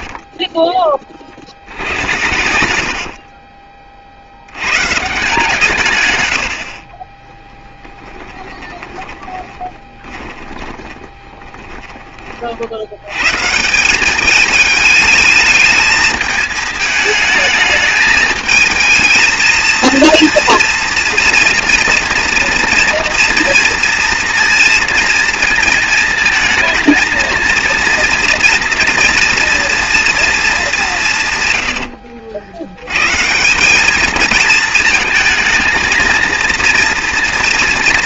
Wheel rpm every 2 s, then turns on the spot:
20, 80, 110, 60, 10, 20, 60, 220, 220, 220, 230, 230, 230, 220, 230, 210, 90, 220, 230.
2-4 8-12